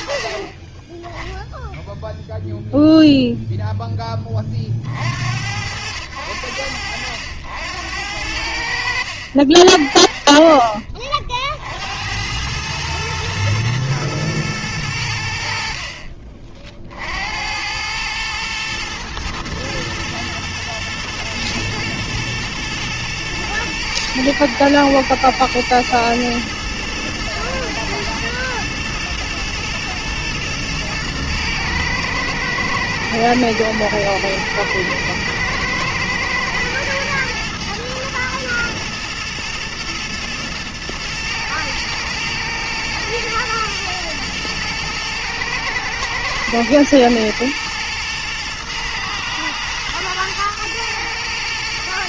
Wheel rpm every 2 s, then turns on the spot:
10, 90, 80, 50, 60, 110, 60, 80, 110, 110, 110, 110, 110, 120, 110, 110, 120, 120, 110, 110, 110, 110, 110, 110, 110, 120.
none